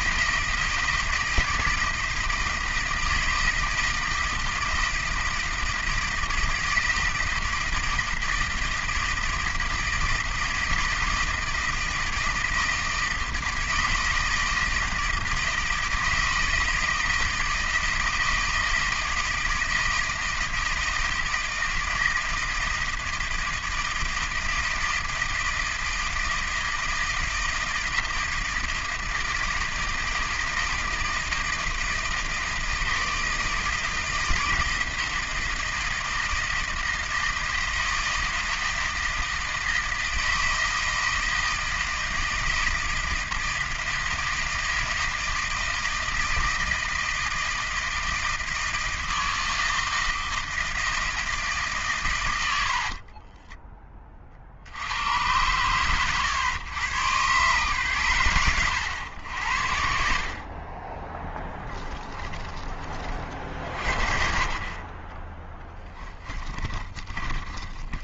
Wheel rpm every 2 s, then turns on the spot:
160, 160, 160, 160, 160, 160, 160, 160, 160, 160, 160, 160, 160, 160, 160, 160, 160, 170, 160, 160, 160, 160, 160, 160, 160, 160, 60, 80, 110, 100, 20, 40, 30, 40.
52-54 62-64 66-68